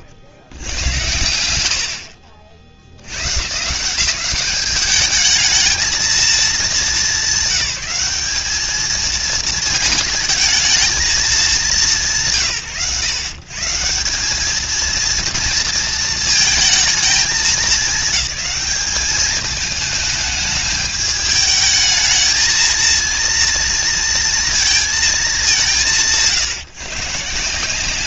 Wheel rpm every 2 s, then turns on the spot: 110, 100, 210, 210, 210, 220, 110, 220, 220, 200, 210, 220, 230, 150.
none